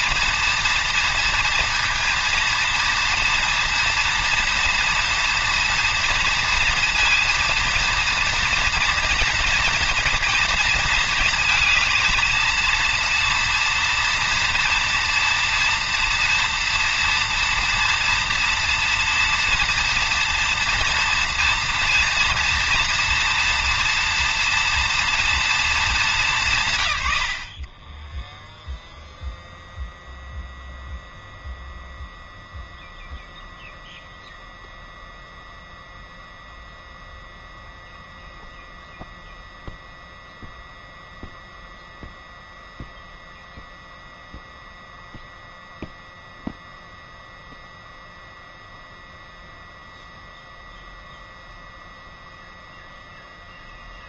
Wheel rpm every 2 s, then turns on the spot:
230, 230, 230, 230, 230, 230, 230, 230, 240, 230, 230, 230, 230, 140, 0, 0, 0, 0, 0, 0, 0, 0, 0, 0, 0, 0, 0.
none